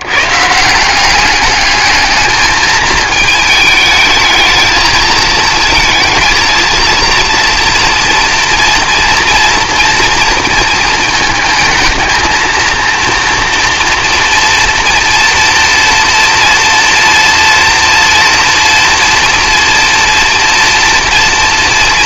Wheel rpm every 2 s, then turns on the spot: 140, 210, 220, 230, 230, 230, 230, 230, 230, 230, 240.
none